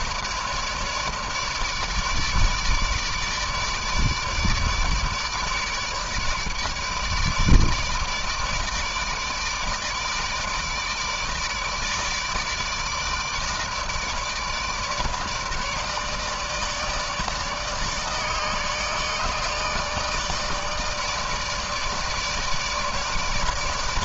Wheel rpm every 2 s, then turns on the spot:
150, 150, 150, 150, 150, 150, 160, 150, 160, 150, 160, 150.
none